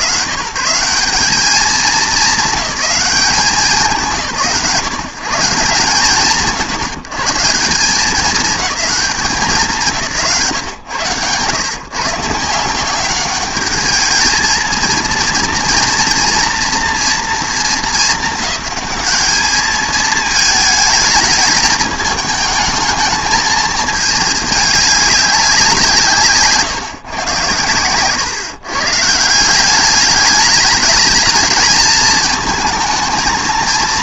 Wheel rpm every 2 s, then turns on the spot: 150, 210, 140, 120, 210, 140, 170, 230, 230, 210, 210, 220, 210, 140, 140, 210, 220.
none